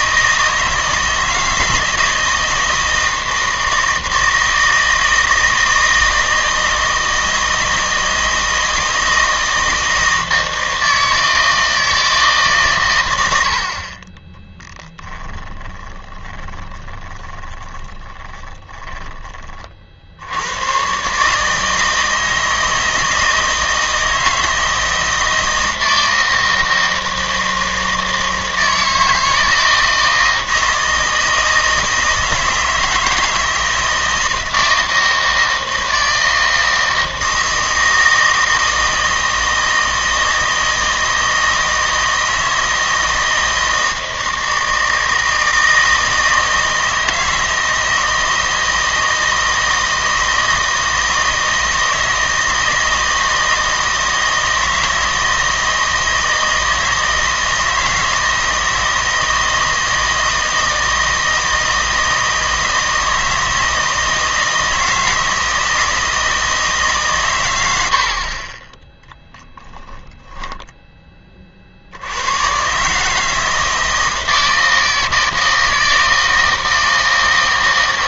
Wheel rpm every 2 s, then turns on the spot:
160, 160, 160, 160, 160, 160, 130, 10, 20, 20, 110, 160, 160, 160, 160, 160, 160, 160, 160, 160, 160, 160, 160, 160, 160, 160, 160, 160, 160, 160, 160, 160, 160, 150, 20, 10, 130, 160, 160.
14-20